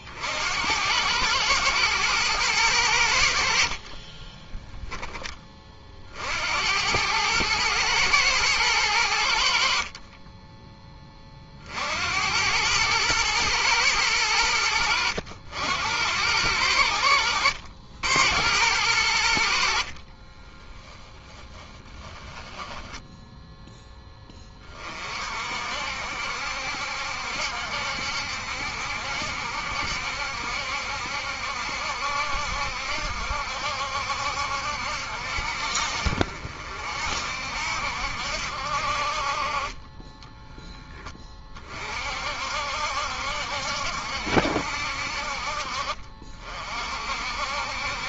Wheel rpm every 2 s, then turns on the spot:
100, 70, 20, 110, 70, 40, 110, 80, 80, 80, 30, 10, 50, 70, 70, 70, 70, 60, 50, 50, 10, 60, 60, 50.
20-24